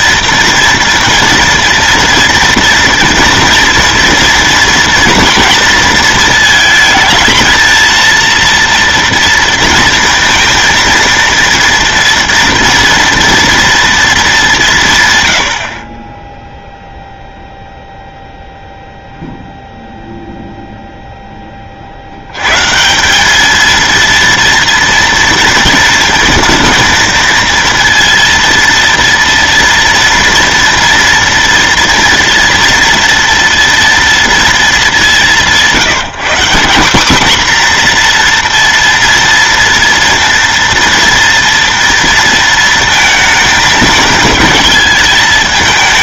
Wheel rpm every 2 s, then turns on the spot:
230, 230, 240, 230, 230, 230, 230, 170, 0, 0, 0, 130, 230, 230, 230, 230, 230, 220, 200, 240, 230, 230, 220.
none